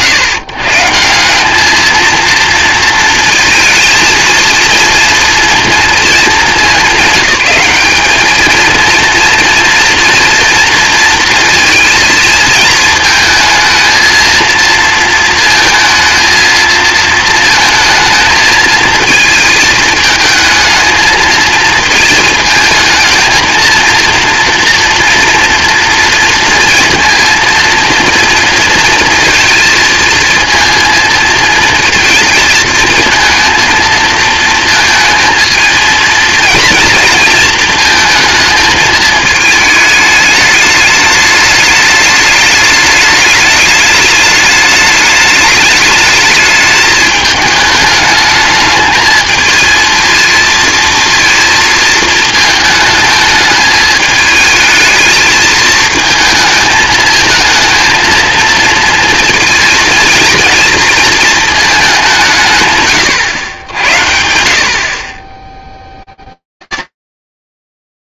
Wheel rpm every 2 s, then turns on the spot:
130, 230, 230, 200, 220, 230, 220, 230, 220, 220, 220, 220, 230, 230, 230, 230, 220, 220, 230, 220, 210, 210, 210, 210, 210, 230, 220, 220, 220, 230, 230, 140, 60, 50.
none